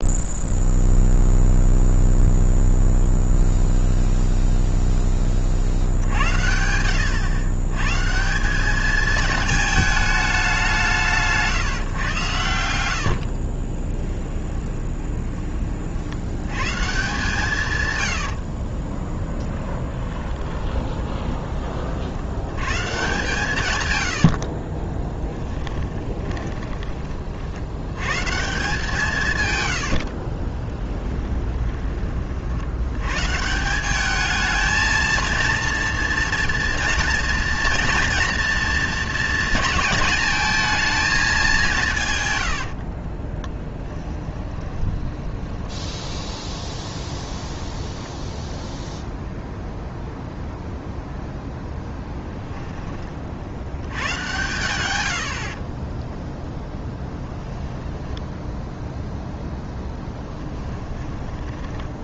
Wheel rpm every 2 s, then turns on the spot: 0, 0, 0, 80, 210, 170, 60, 20, 140, 30, 20, 120, 40, 20, 170, 10, 80, 220, 230, 230, 220, 50, 20, 20, 0, 0, 20, 90, 0, 0, 10.
12-16 18-22 24-26 30-32 42-48 60-62